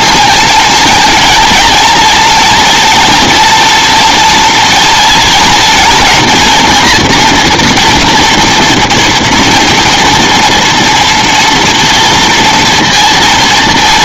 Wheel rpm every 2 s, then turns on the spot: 230, 230, 240, 230, 230, 230, 230.
none